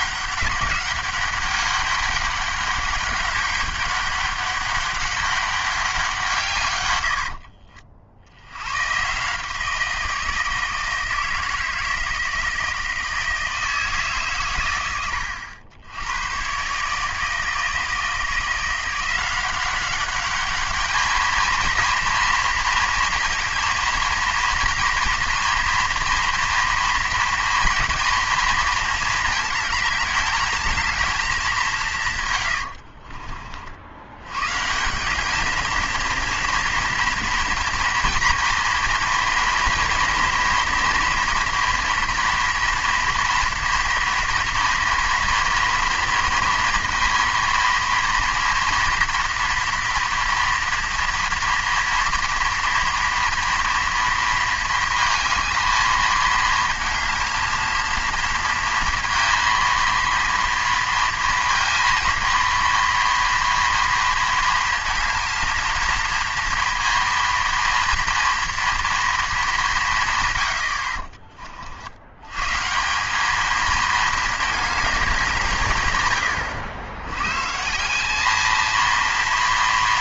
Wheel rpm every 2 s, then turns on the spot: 190, 200, 200, 120, 110, 160, 160, 110, 130, 170, 210, 230, 240, 230, 230, 220, 70, 150, 230, 230, 240, 230, 230, 230, 230, 230, 230, 230, 220, 230, 230, 230, 230, 230, 230, 90, 150, 210, 80, 220.
32-34